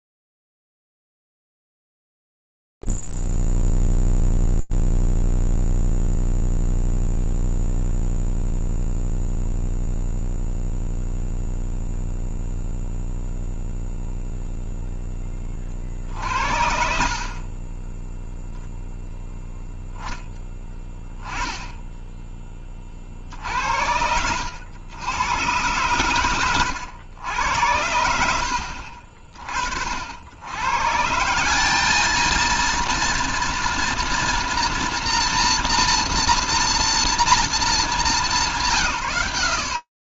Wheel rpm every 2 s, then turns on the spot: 0, 0, 0, 0, 0, 0, 0, 0, 50, 10, 10, 20, 100, 110, 60, 120, 230, 240, 240, 180.
none